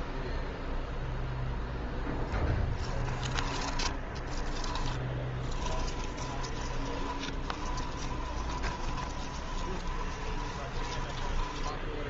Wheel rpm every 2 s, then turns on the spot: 20, 10, 10, 20, 20, 20.
2-12